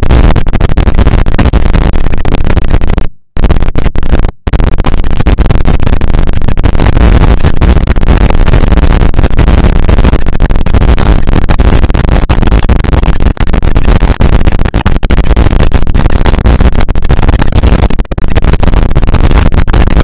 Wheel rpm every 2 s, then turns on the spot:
210, 150, 130, 220, 230, 230, 220, 230, 220, 150.
none